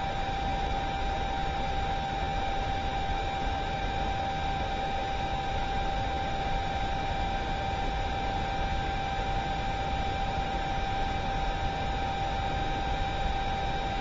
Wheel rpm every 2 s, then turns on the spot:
0, 0, 0, 0, 0, 0, 0.
none